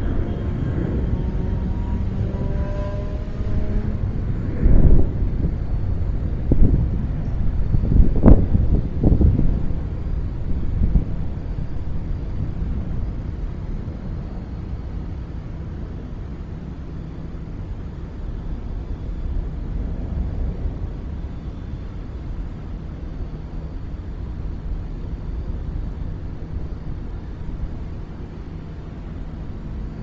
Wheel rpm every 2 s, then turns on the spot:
0, 0, 0, 0, 0, 0, 0, 0, 0, 0, 0, 0, 0, 0, 0.
none